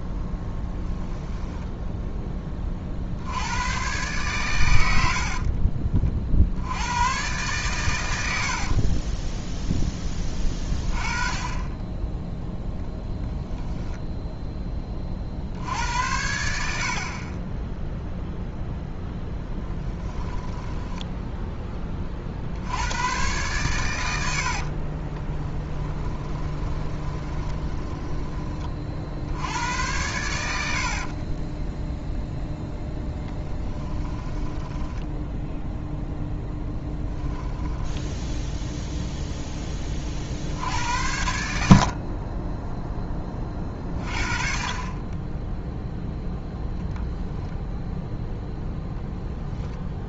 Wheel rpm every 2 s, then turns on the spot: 10, 40, 90, 90, 40, 20, 10, 20, 60, 0, 10, 90, 30, 20, 40, 60, 0, 10, 10, 0, 80, 10, 30, 0, 0.
0-2 8-10 20-22 24-28 34-36